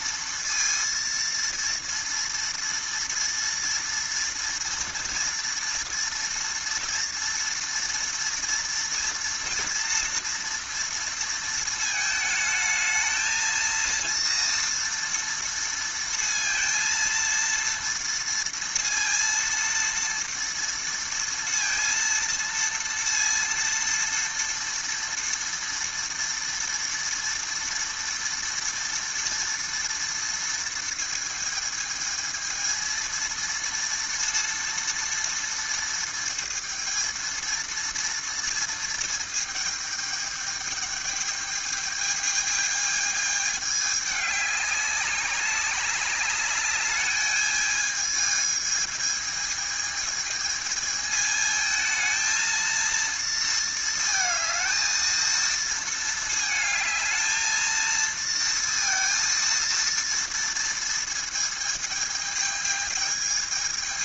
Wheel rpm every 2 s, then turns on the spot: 230, 230, 230, 230, 230, 230, 220, 230, 230, 230, 230, 230, 230, 230, 230, 230, 230, 230, 230, 230, 210, 220, 200, 210, 220, 220, 230, 220, 220, 230, 230, 220.
none